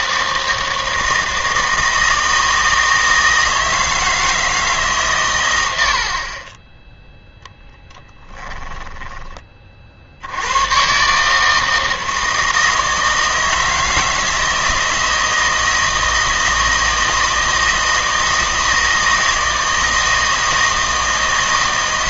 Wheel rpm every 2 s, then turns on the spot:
160, 160, 150, 20, 10, 110, 160, 160, 160, 160, 160.
8-10